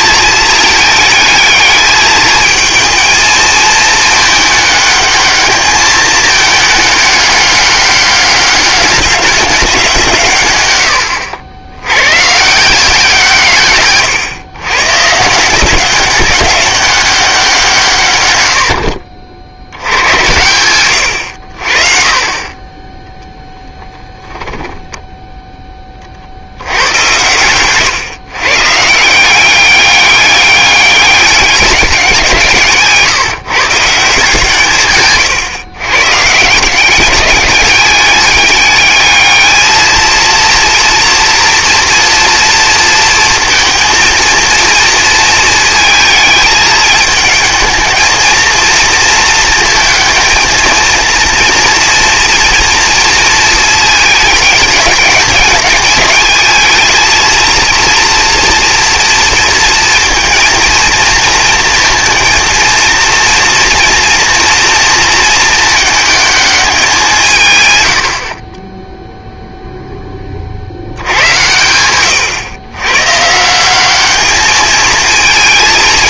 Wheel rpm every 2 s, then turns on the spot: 220, 220, 210, 210, 200, 120, 170, 130, 200, 80, 110, 10, 10, 70, 140, 200, 150, 140, 180, 210, 230, 230, 230, 220, 230, 230, 230, 220, 220, 240, 230, 230, 230, 210, 0, 60, 120, 220.
18-20 24-26